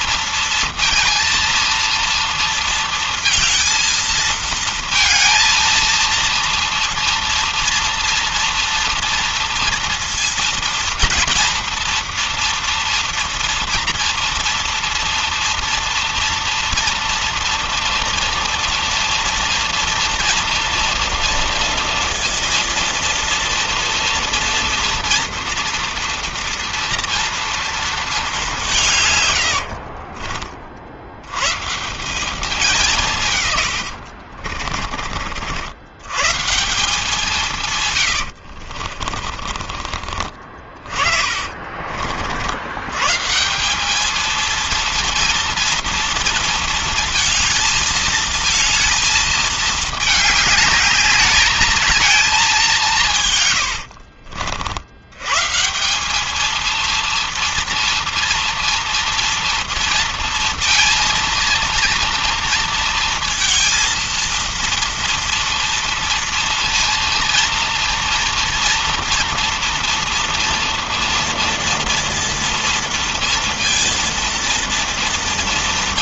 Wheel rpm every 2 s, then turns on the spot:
230, 230, 230, 240, 230, 230, 230, 230, 240, 240, 230, 230, 240, 230, 140, 90, 170, 50, 170, 40, 40, 130, 230, 230, 220, 210, 160, 100, 230, 230, 230, 230, 230, 230, 230, 230, 230, 230.
28-30 38-42